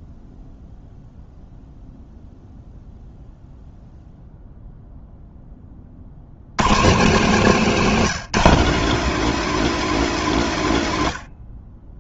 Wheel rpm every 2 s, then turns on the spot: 0, 0, 0, 160, 210, 110.
none